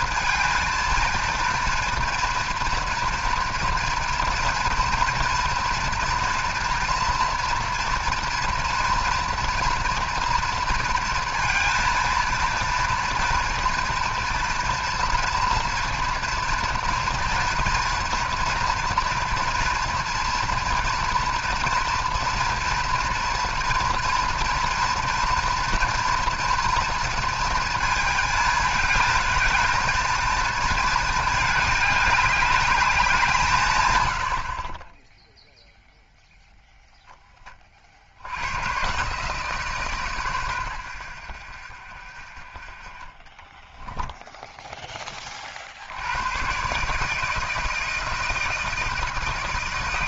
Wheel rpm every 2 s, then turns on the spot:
230, 240, 230, 230, 230, 230, 230, 230, 230, 230, 240, 240, 230, 230, 220, 220, 200, 30, 0, 120, 100, 30, 10, 130, 160.
none